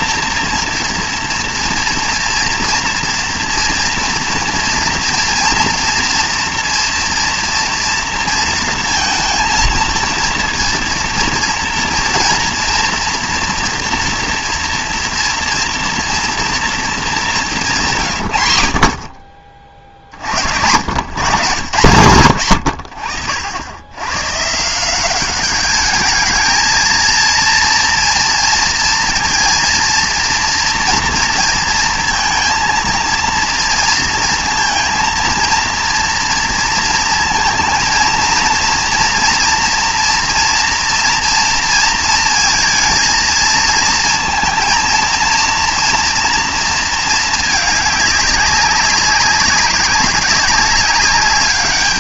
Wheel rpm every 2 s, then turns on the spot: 230, 230, 230, 230, 230, 230, 240, 240, 230, 110, 90, 100, 150, 220, 230, 230, 230, 230, 230, 230, 230, 230, 230, 230, 190, 200.
none